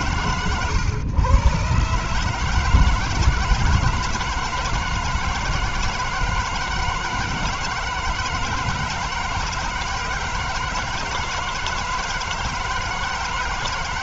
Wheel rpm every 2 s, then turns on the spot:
120, 160, 160, 160, 160, 160, 160.
none